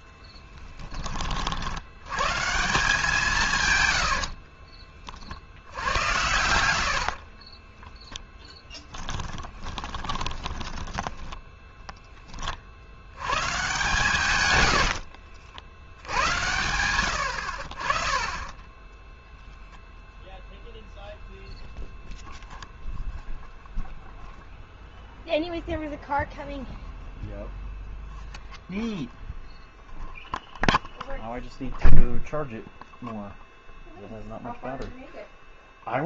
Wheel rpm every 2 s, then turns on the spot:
10, 160, 40, 80, 10, 20, 50, 100, 90, 10, 0, 0, 0, 0, 0, 0, 0, 0.
4-12 18-20